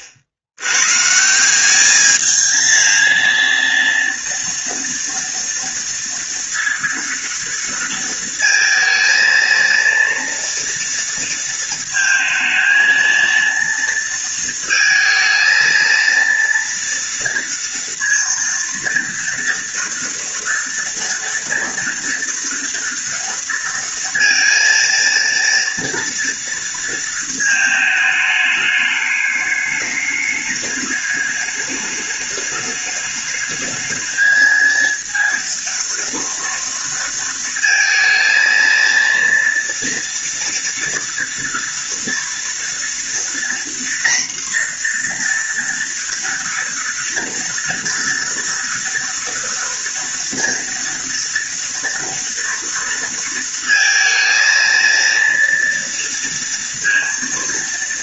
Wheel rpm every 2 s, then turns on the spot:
90, 220, 230, 230, 220, 230, 220, 230, 230, 230, 230, 230, 230, 230, 210, 210, 210, 220, 230, 230, 230, 230, 240, 230, 240, 230, 230, 230, 230.
none